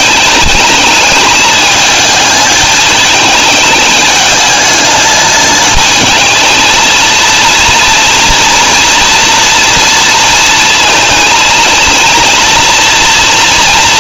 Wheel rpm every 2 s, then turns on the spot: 210, 220, 220, 230, 230, 230, 230.
none